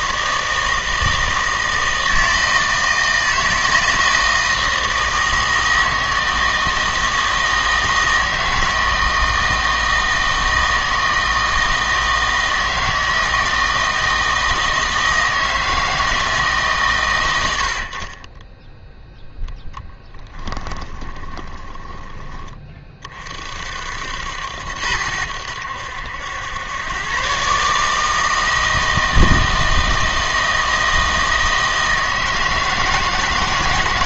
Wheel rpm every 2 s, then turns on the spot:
160, 160, 160, 160, 160, 160, 160, 160, 140, 10, 20, 30, 80, 100, 160, 160, 160.
20-22